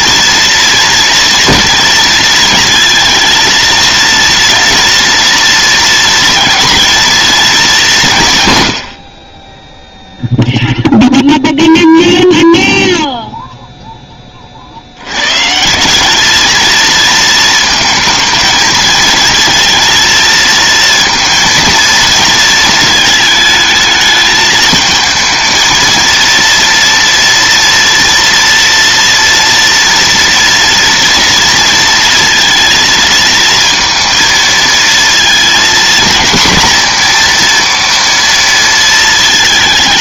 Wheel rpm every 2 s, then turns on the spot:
230, 230, 230, 230, 60, 0, 0, 120, 230, 220, 230, 220, 230, 230, 230, 230, 230, 230, 240, 220.
none